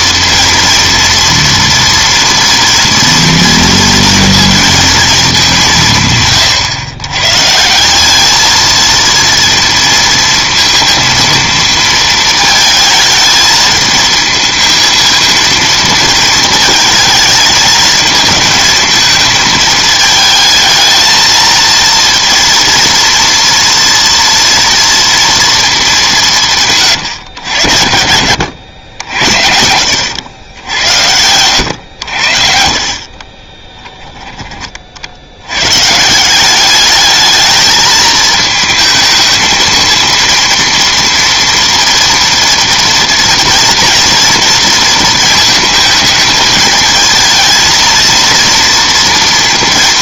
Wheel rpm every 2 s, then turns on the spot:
230, 230, 230, 110, 230, 230, 220, 230, 220, 220, 220, 230, 230, 150, 80, 90, 60, 30, 200, 220, 230, 240, 230, 220, 230.
30-32